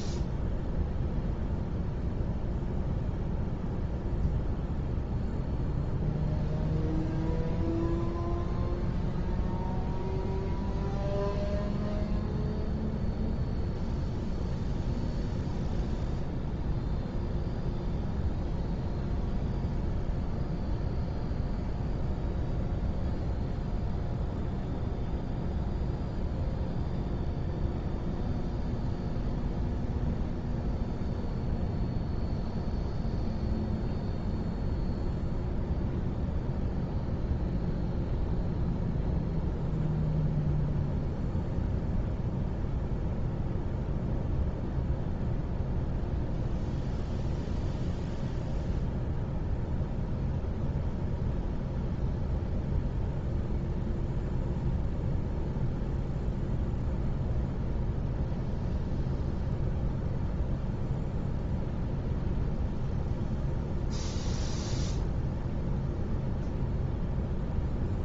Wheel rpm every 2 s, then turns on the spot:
0, 0, 0, 0, 0, 0, 0, 0, 0, 0, 0, 0, 0, 0, 0, 0, 0, 0, 0, 0, 0, 0, 0, 0, 0, 0, 0, 0, 0, 0, 0, 0, 0, 0.
none